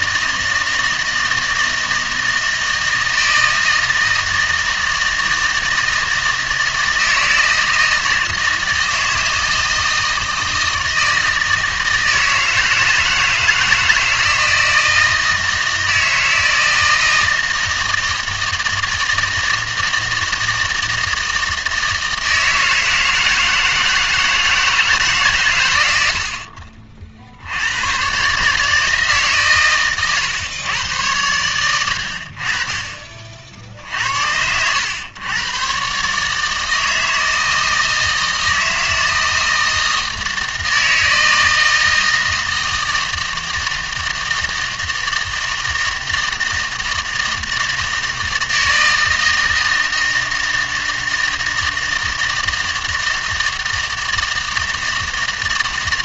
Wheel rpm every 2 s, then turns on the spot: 160, 160, 160, 160, 160, 160, 160, 160, 160, 160, 160, 160, 160, 40, 150, 120, 40, 90, 160, 160, 160, 160, 160, 160, 160, 160, 160, 160.
none